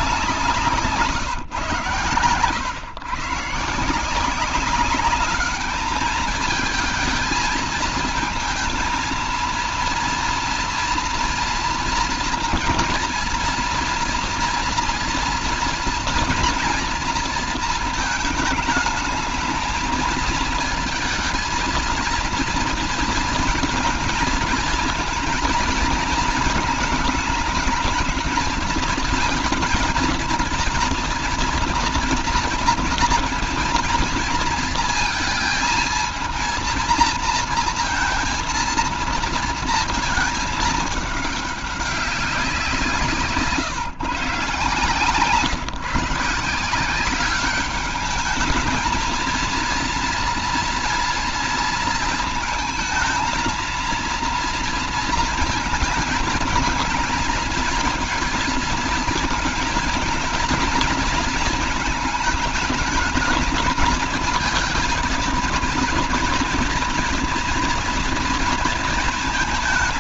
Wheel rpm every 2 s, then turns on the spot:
150, 130, 200, 220, 230, 240, 230, 230, 230, 220, 230, 230, 230, 220, 230, 230, 230, 230, 230, 230, 210, 150, 140, 190, 230, 230, 220, 230, 220, 220, 230, 220, 230, 240, 230.
none